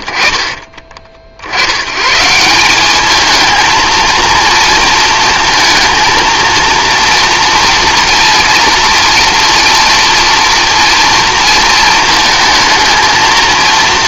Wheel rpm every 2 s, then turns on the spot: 40, 190, 230, 230, 230, 230, 230.
0-2